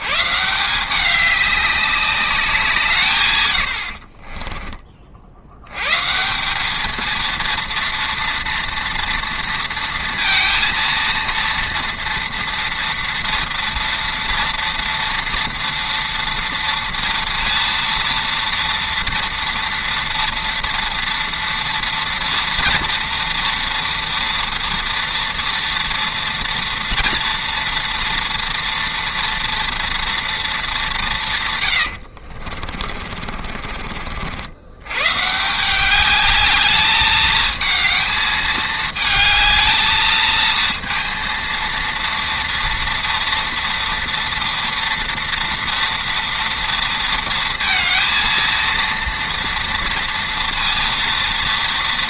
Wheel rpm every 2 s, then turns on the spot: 180, 170, 30, 200, 230, 230, 230, 230, 230, 230, 230, 230, 240, 230, 230, 210, 40, 100, 210, 220, 220, 230, 240, 230, 230, 230.
4-6 32-34